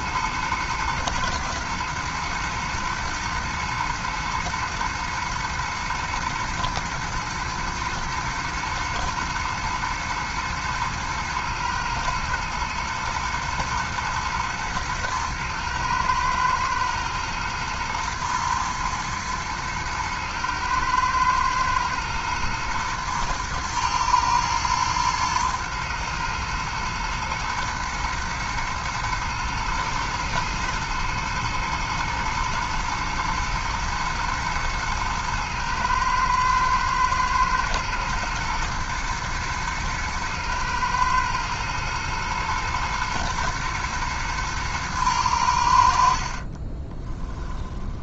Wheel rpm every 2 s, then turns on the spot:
110, 120, 110, 120, 110, 110, 110, 110, 110, 110, 110, 110, 110, 120, 120, 110, 110, 110, 110, 120, 120, 120, 110, 30.
46-48